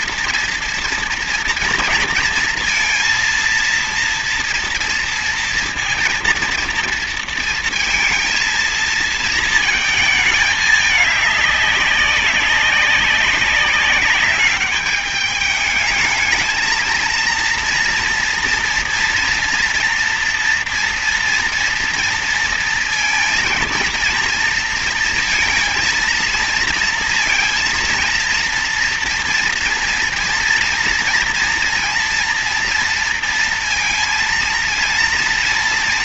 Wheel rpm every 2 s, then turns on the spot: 230, 230, 230, 230, 230, 220, 200, 210, 220, 240, 230, 230, 230, 230, 230, 230, 230, 230.
none